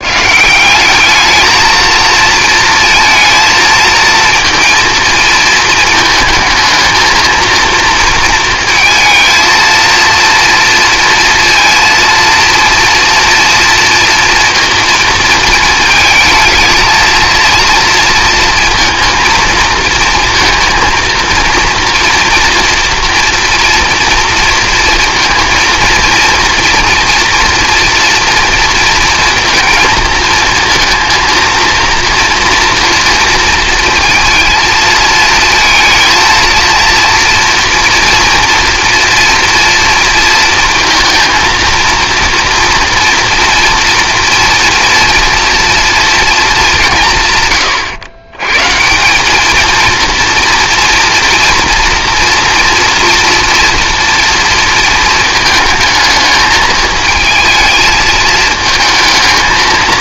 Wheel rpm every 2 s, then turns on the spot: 190, 230, 230, 220, 230, 230, 230, 230, 220, 230, 230, 230, 230, 240, 230, 230, 230, 230, 230, 230, 230, 230, 230, 190, 140, 230, 230, 230, 220, 220.
none